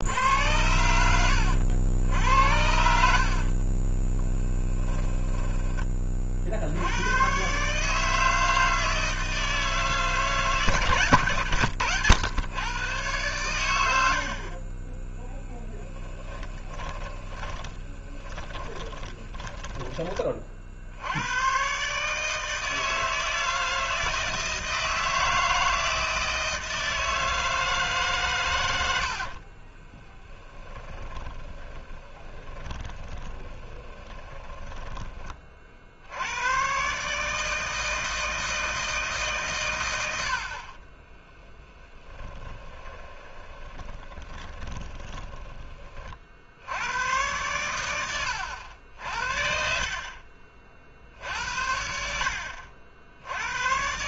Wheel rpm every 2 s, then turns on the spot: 80, 80, 10, 50, 160, 150, 110, 50, 20, 20, 30, 160, 160, 160, 120, 30, 20, 20, 100, 160, 70, 20, 30, 60, 90, 40, 70.
2-6 16-20 30-36 42-46